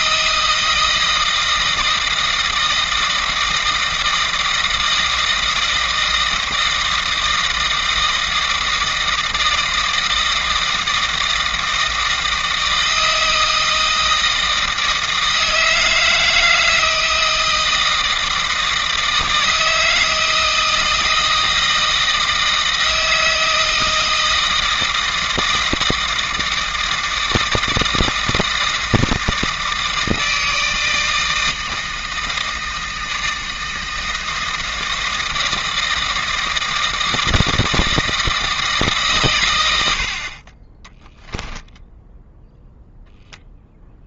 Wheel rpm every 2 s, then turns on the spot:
160, 160, 160, 160, 160, 160, 160, 160, 160, 160, 160, 160, 160, 160, 160, 160, 160, 160, 160, 150, 10, 0.
40-42